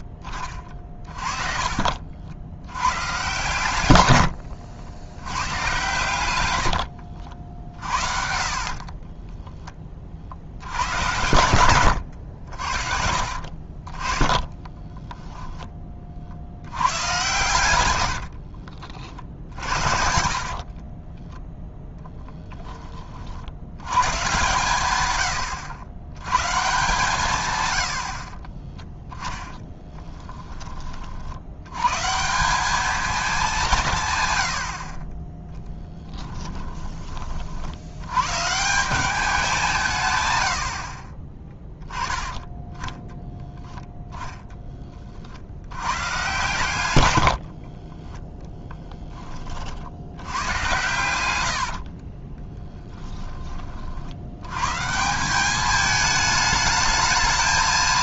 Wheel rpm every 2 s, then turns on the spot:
30, 100, 70, 100, 50, 80, 70, 20, 70, 50, 50, 20, 130, 130, 20, 20, 190, 90, 10, 150, 90, 10, 10, 110, 10, 110, 10, 120, 220.
4-10 14-16 18-22 28-30 36-38 52-54